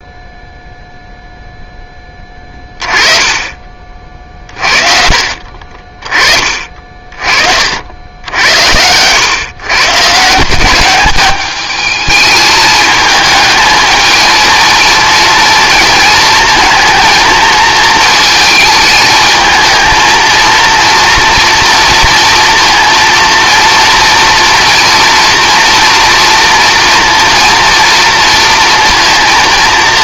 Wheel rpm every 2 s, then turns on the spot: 0, 20, 30, 40, 90, 190, 220, 230, 220, 220, 230, 230, 240, 230, 230.
2-4